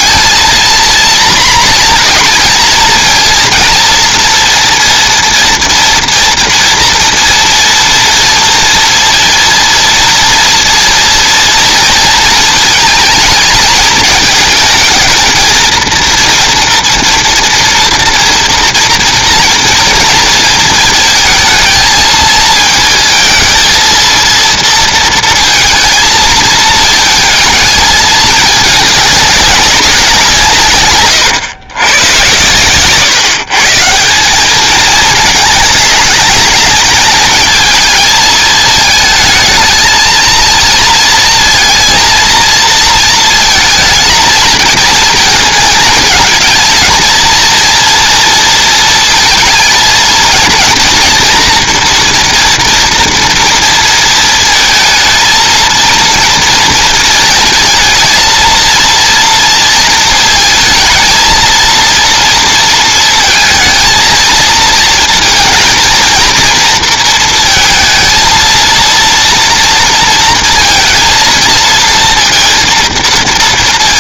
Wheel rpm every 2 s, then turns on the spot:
230, 230, 230, 230, 230, 230, 230, 220, 230, 230, 220, 220, 230, 220, 210, 150, 120, 210, 220, 220, 230, 230, 220, 220, 230, 230, 230, 220, 230, 230, 220, 230, 220, 230, 230, 230, 230.
none